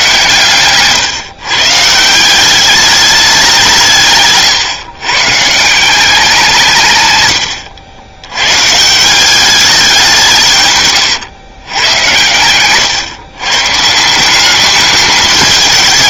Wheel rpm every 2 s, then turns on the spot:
130, 190, 130, 160, 130, 140, 110, 200.
none